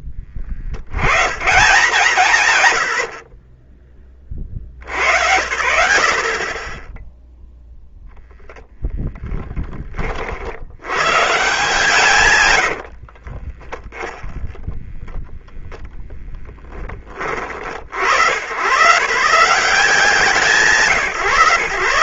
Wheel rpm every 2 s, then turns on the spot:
10, 160, 30, 30, 10, 60, 100, 10, 10, 90, 170.
8-10 14-18